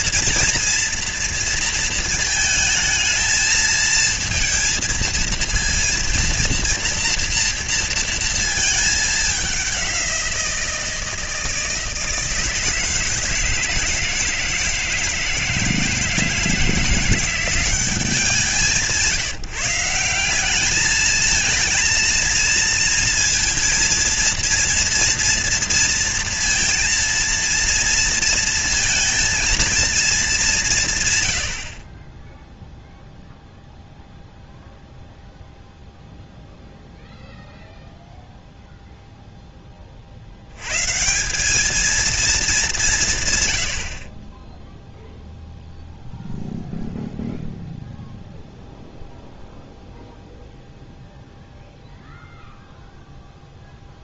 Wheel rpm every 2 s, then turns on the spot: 240, 220, 230, 230, 220, 170, 160, 160, 170, 170, 200, 230, 230, 230, 230, 190, 0, 0, 0, 0, 110, 190, 0, 0, 0, 0, 0.
none